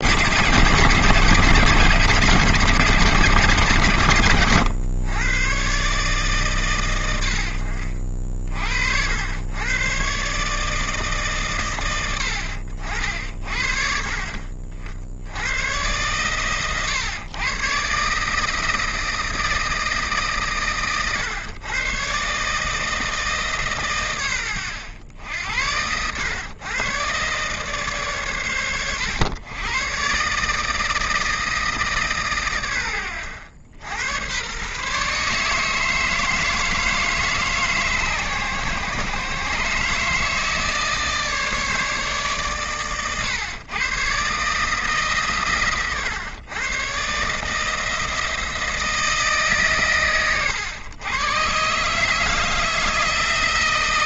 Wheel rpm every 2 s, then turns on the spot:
140, 150, 120, 130, 50, 150, 80, 50, 120, 160, 140, 150, 100, 110, 120, 150, 120, 110, 160, 130, 160, 130, 140, 120, 170, 120, 160.
none